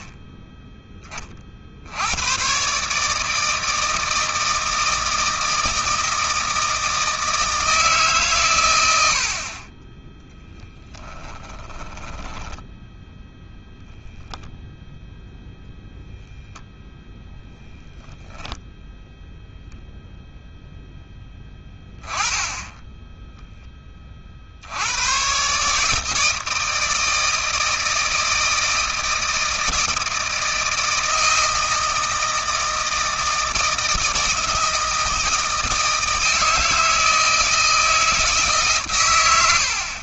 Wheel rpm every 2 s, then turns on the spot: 20, 150, 160, 160, 80, 10, 0, 0, 10, 0, 10, 10, 100, 160, 160, 160, 160, 160, 160, 130.
10-12